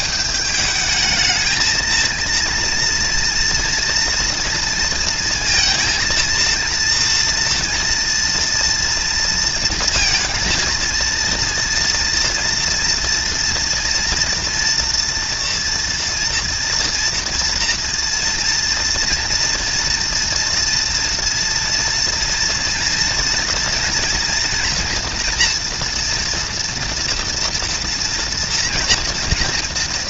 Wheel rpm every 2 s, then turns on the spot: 210, 230, 230, 230, 240, 230, 230, 240, 230, 230, 230, 230, 230, 230, 240.
none